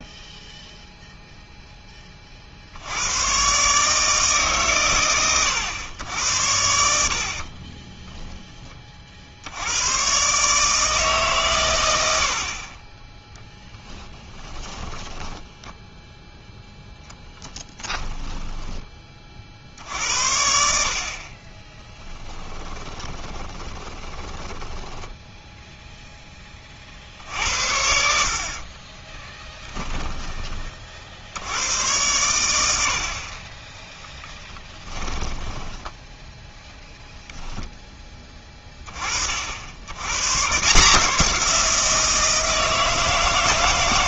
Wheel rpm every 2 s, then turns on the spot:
0, 90, 130, 80, 20, 150, 20, 10, 0, 10, 60, 20, 10, 40, 30, 50, 70, 10, 0, 30, 150, 160.
14-16 22-26 28-30 34-36